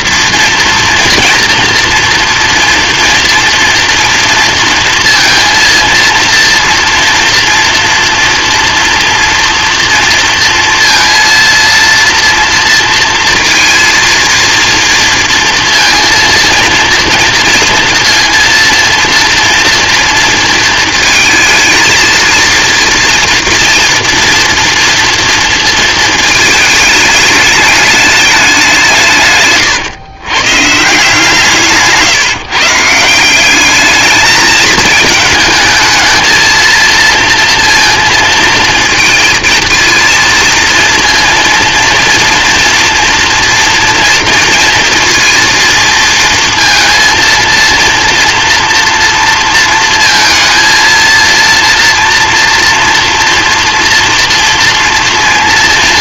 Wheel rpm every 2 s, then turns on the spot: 240, 230, 230, 230, 240, 230, 230, 230, 230, 230, 230, 230, 230, 220, 190, 140, 150, 210, 230, 230, 230, 230, 230, 230, 230, 230, 240, 230.
none